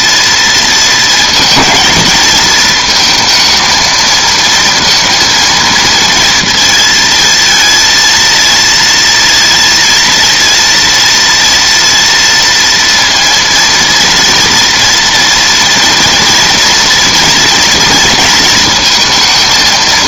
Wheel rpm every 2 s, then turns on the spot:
230, 220, 230, 230, 230, 230, 230, 230, 230, 230.
none